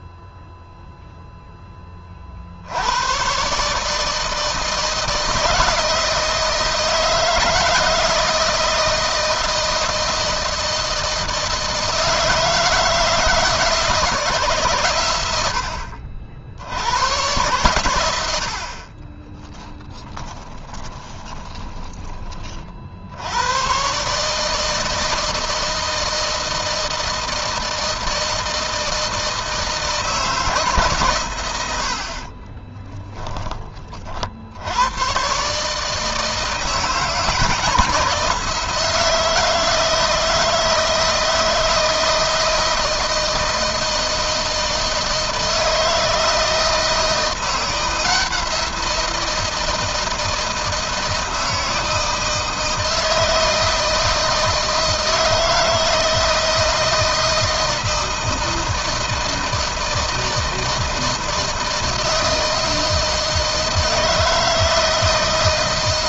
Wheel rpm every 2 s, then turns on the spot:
0, 110, 160, 170, 160, 160, 160, 110, 100, 30, 20, 70, 160, 160, 160, 130, 10, 110, 170, 160, 160, 160, 160, 170, 170, 160, 160, 160, 160, 160, 160, 160, 160.
18-22